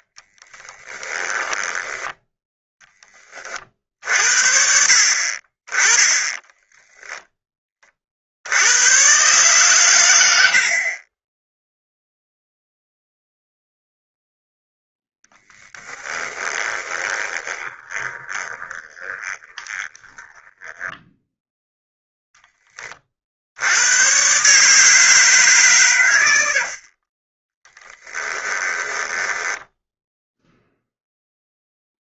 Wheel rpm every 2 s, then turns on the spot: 20, 20, 50, 10, 110, 30, 0, 0, 20, 20, 10, 30, 150, 40, 10, 0.
0-2 6-8 16-22 26-30